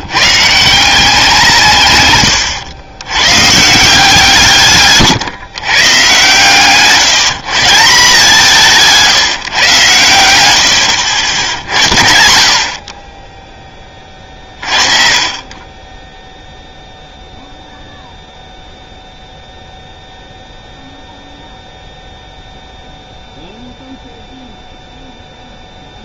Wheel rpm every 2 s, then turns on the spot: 170, 100, 140, 150, 170, 80, 60, 30, 0, 0, 0, 0, 0.
none